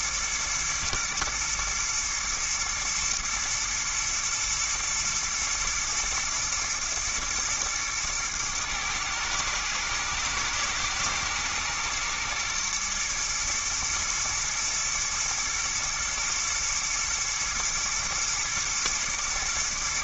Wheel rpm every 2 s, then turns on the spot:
120, 110, 110, 110, 110, 110, 120, 120, 120, 110.
none